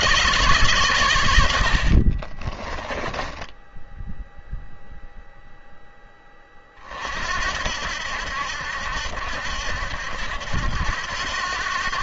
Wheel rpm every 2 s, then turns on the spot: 130, 30, 0, 30, 70, 80.
2-4